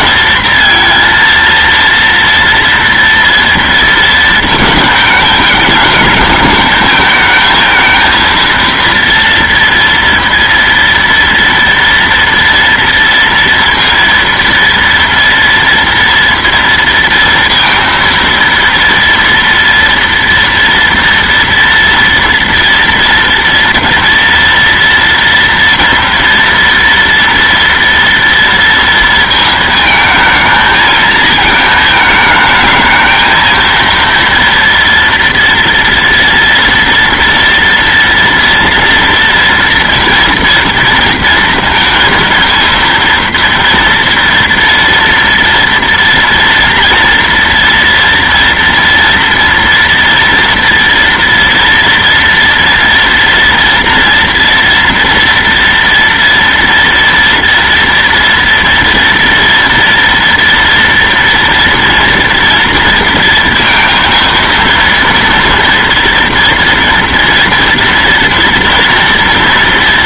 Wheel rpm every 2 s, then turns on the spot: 230, 230, 220, 220, 230, 230, 230, 230, 230, 230, 230, 230, 230, 230, 230, 220, 220, 240, 230, 230, 230, 230, 230, 230, 230, 230, 230, 230, 240, 230, 230, 230, 230, 230, 230.
none